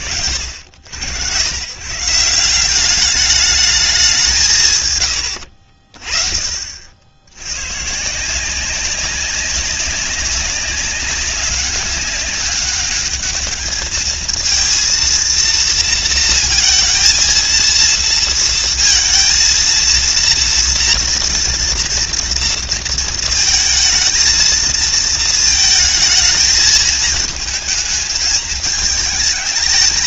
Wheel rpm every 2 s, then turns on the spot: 80, 200, 110, 60, 190, 200, 210, 230, 230, 230, 240, 230, 230, 220, 210.
none